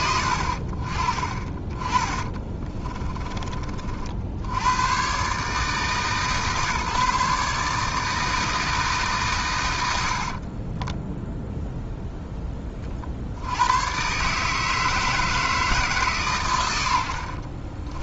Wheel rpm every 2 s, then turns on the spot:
50, 20, 90, 150, 160, 20, 30, 160, 110.
2-4 10-12 16-18